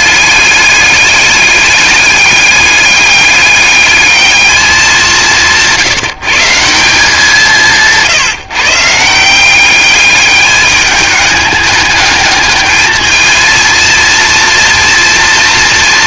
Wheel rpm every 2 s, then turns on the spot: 210, 210, 210, 160, 150, 210, 220, 230.
none